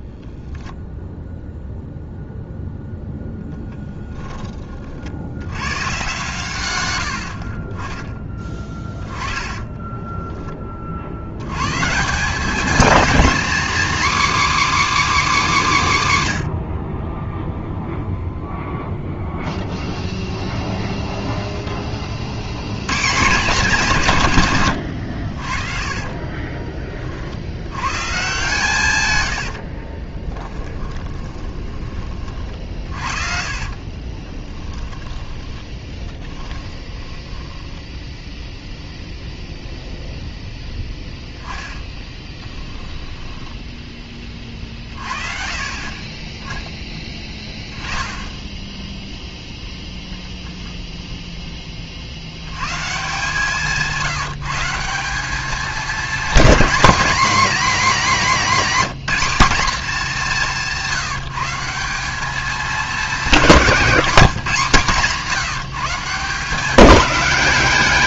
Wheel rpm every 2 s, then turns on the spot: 0, 0, 40, 100, 20, 40, 240, 310, 60, 0, 0, 120, 100, 30, 130, 20, 50, 10, 10, 0, 0, 10, 30, 10, 10, 0, 130, 180, 260, 240, 180, 210, 170, 180.
8-10 30-38